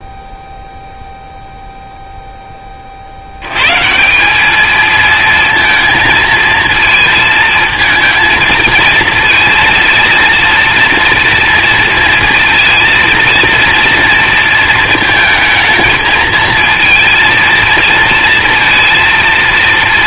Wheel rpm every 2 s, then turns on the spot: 0, 20, 220, 230, 230, 230, 230, 230, 230, 230.
none